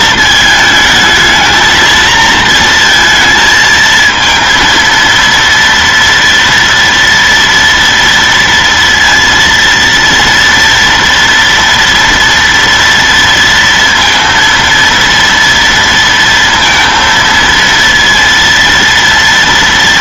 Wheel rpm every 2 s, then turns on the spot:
220, 230, 220, 230, 230, 230, 230, 230, 230, 230.
none